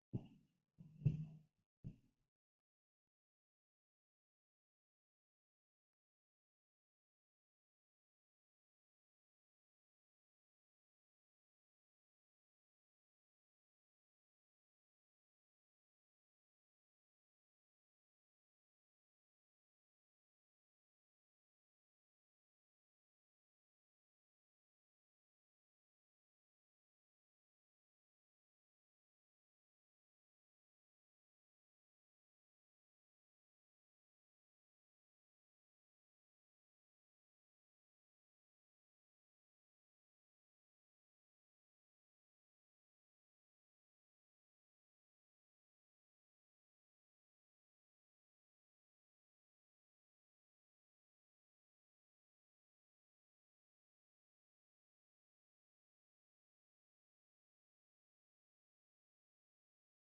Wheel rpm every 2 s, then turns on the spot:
0, 0, 0, 0, 0, 0, 0, 0, 0, 0, 0, 0, 0, 0, 0, 0, 0, 0, 0, 0, 0, 0, 0, 0, 0, 0, 0, 0, 0, 0.
none